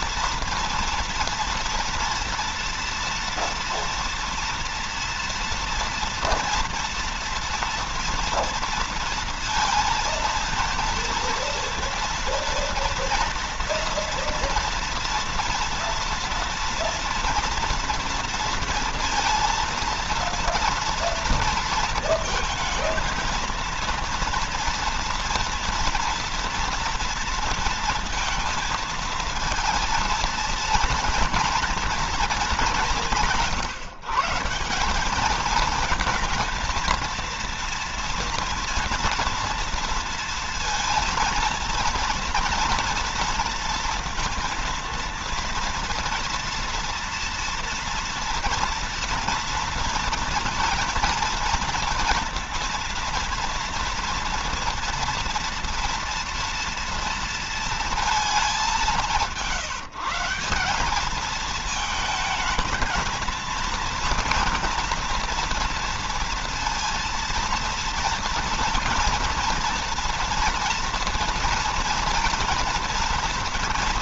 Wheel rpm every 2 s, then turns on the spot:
230, 230, 230, 230, 230, 230, 230, 230, 230, 230, 230, 230, 230, 230, 230, 240, 170, 200, 230, 230, 230, 230, 230, 230, 230, 230, 230, 230, 230, 190, 200, 230, 240, 230, 230, 240, 230.
none